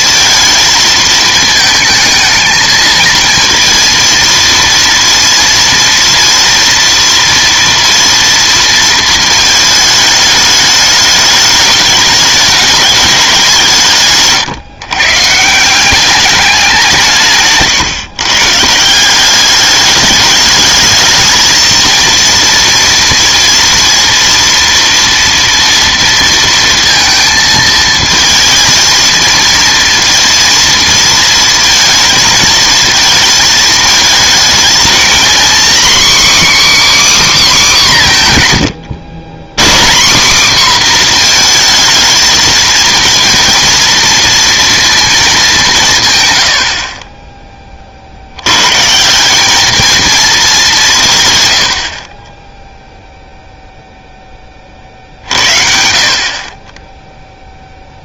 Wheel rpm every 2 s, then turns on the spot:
220, 220, 230, 230, 230, 210, 210, 120, 200, 150, 210, 230, 230, 230, 230, 230, 220, 230, 290, 130, 250, 230, 230, 80, 120, 200, 10, 30, 30.
none